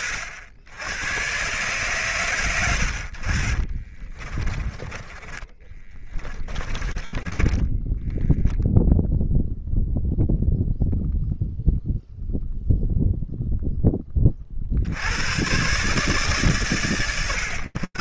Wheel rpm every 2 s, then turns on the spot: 80, 70, 10, 20, 0, 0, 0, 30, 130.
4-8